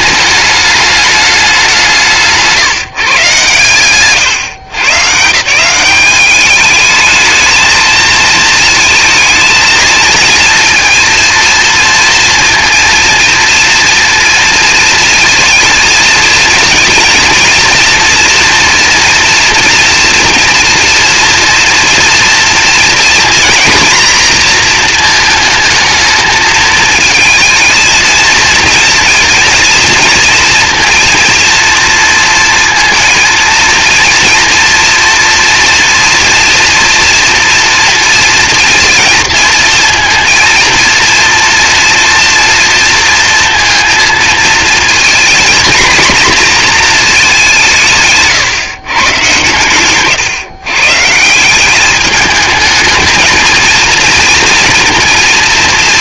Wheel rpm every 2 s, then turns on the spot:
210, 160, 140, 210, 230, 230, 230, 230, 230, 240, 230, 230, 230, 220, 230, 230, 230, 240, 240, 230, 230, 230, 240, 230, 130, 140, 220, 230.
none